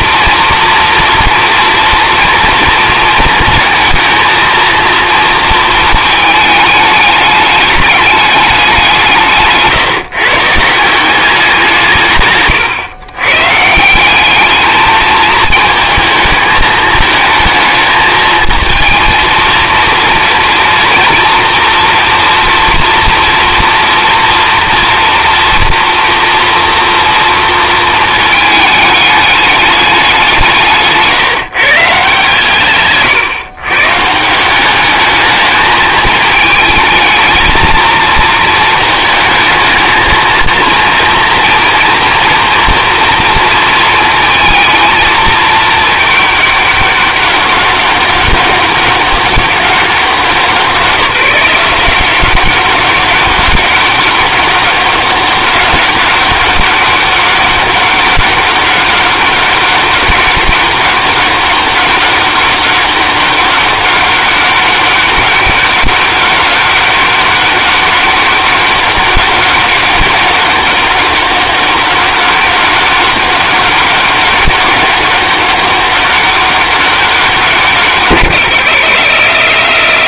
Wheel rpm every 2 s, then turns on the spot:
230, 230, 230, 220, 190, 160, 120, 210, 220, 220, 240, 230, 230, 240, 210, 170, 140, 200, 220, 220, 230, 240, 230, 200, 200, 170, 190, 200, 200, 200, 200, 200, 200, 200, 200, 200, 200, 200, 200, 110.
30-32